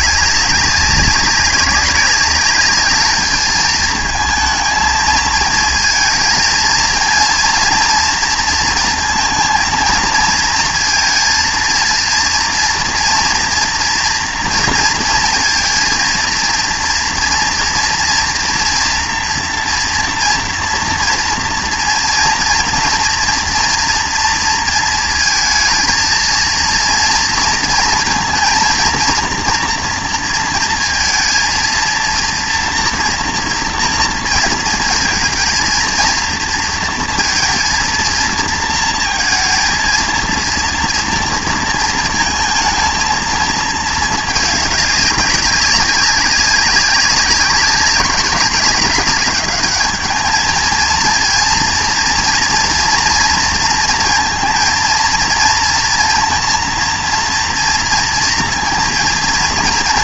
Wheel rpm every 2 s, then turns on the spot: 190, 200, 230, 220, 230, 230, 230, 230, 230, 230, 230, 230, 230, 230, 230, 230, 230, 230, 230, 230, 230, 220, 210, 200, 190, 220, 240, 230, 230, 240.
none